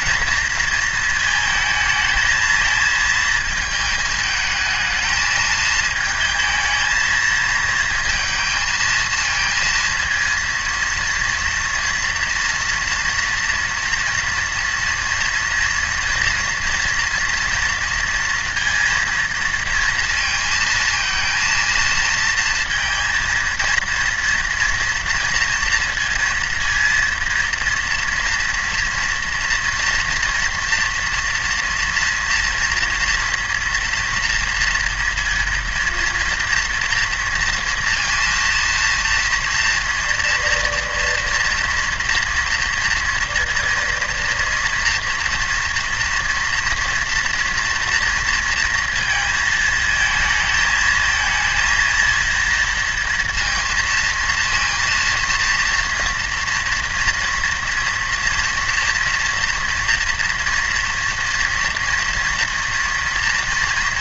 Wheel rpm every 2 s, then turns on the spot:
230, 220, 220, 220, 220, 230, 240, 230, 240, 230, 230, 220, 230, 230, 230, 240, 230, 230, 230, 230, 230, 230, 230, 230, 230, 230, 230, 230, 240, 230, 230, 230.
none